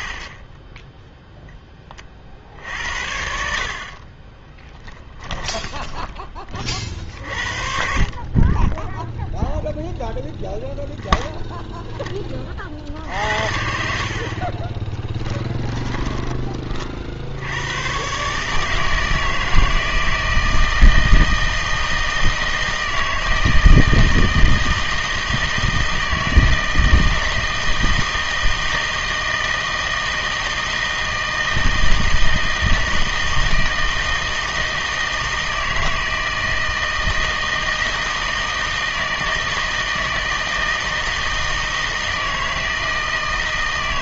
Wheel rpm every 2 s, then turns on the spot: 10, 70, 20, 40, 10, 0, 50, 20, 30, 150, 160, 160, 160, 160, 160, 160, 160, 160, 160, 160, 160, 160.
4-6 14-16